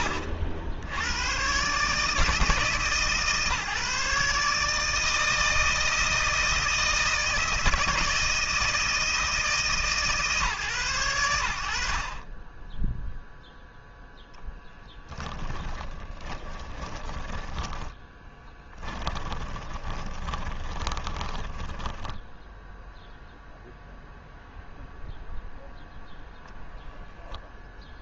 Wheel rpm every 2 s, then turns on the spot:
90, 150, 160, 160, 160, 130, 10, 0, 20, 10, 20, 0, 0, 0.
16-22